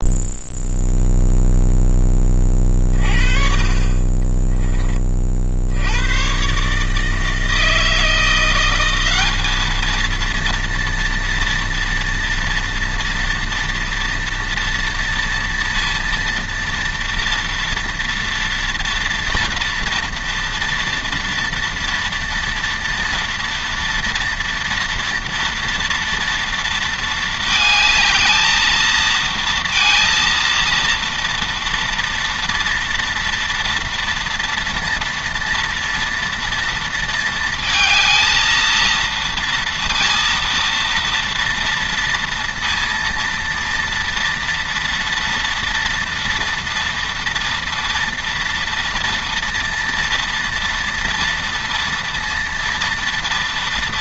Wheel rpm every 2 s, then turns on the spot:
0, 30, 20, 150, 180, 230, 230, 230, 230, 240, 230, 240, 240, 230, 220, 230, 230, 230, 230, 230, 230, 230, 230, 230, 230, 230, 230.
none